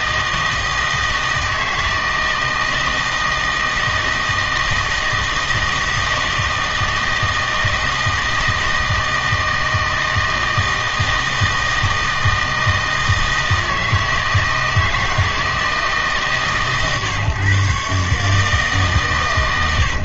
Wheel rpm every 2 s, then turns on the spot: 160, 160, 160, 160, 160, 160, 160, 160, 130, 150.
none